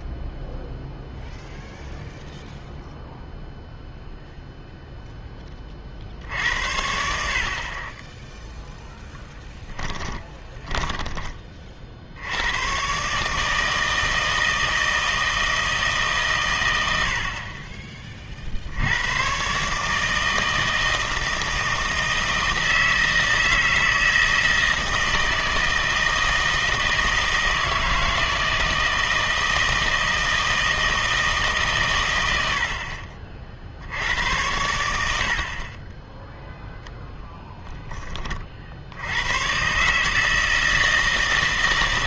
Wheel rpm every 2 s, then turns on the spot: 0, 0, 0, 70, 0, 20, 110, 160, 110, 60, 160, 160, 160, 160, 160, 160, 60, 90, 0, 50, 160.
10-12